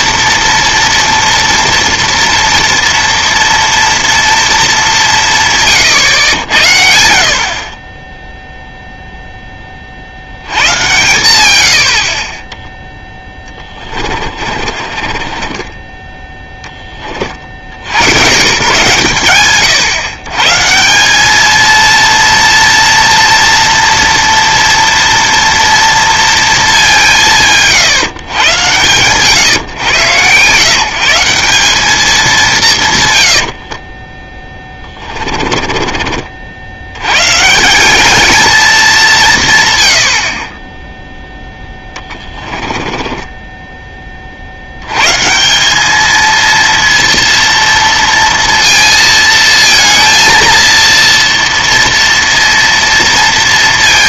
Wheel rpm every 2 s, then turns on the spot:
230, 230, 210, 80, 0, 90, 10, 30, 10, 130, 150, 230, 230, 210, 120, 140, 170, 10, 80, 220, 20, 10, 80, 230, 230, 230, 230.
14-16 34-36 42-44